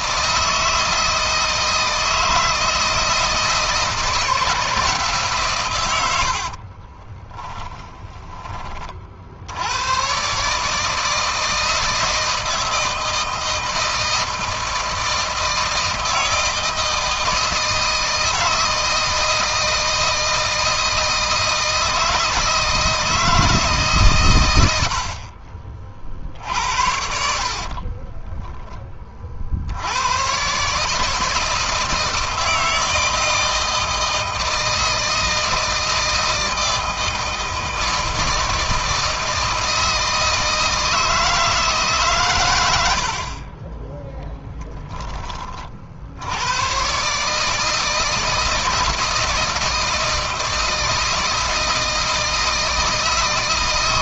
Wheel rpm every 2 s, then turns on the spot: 160, 160, 160, 40, 20, 140, 160, 160, 160, 160, 160, 160, 90, 60, 20, 140, 160, 160, 160, 160, 160, 110, 10, 110, 160, 160, 160.
6-8